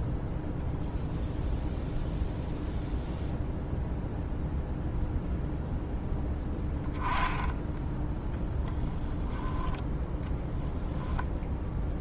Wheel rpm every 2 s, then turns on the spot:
0, 0, 0, 10, 10, 10.
none